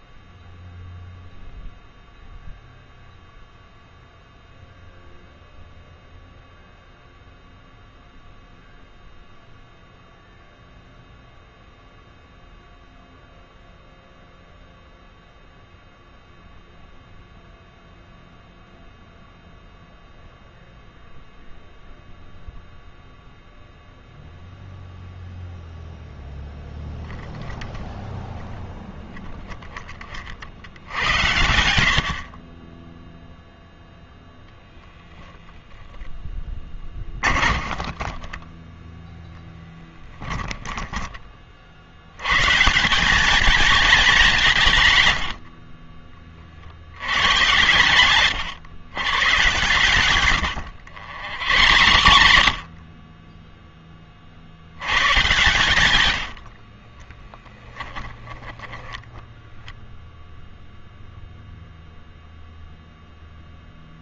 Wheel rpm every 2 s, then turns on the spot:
0, 0, 0, 0, 0, 0, 0, 0, 0, 0, 0, 0, 0, 10, 0, 70, 20, 0, 20, 10, 10, 150, 140, 50, 110, 110, 50, 80, 50, 10, 0, 0.
36-42 50-54 56-60